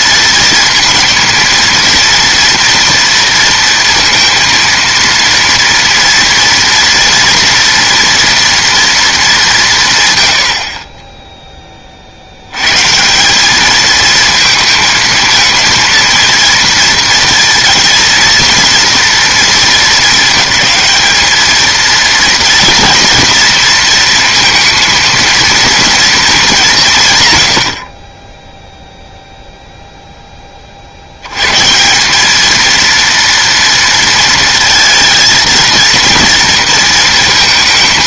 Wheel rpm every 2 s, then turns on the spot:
230, 230, 230, 230, 240, 60, 120, 220, 230, 230, 220, 230, 230, 190, 0, 40, 220, 230, 230.
none